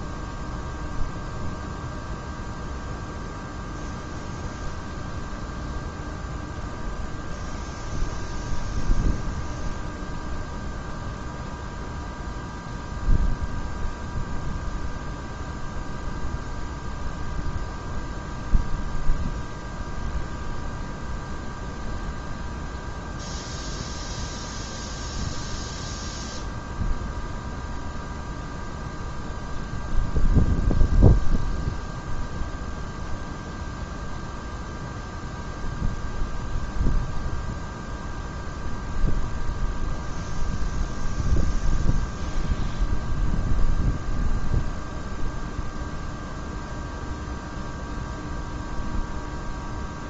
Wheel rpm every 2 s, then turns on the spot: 0, 0, 0, 0, 0, 0, 0, 0, 0, 0, 0, 0, 0, 0, 0, 0, 0, 0, 0, 0, 0, 0, 0, 0, 0.
none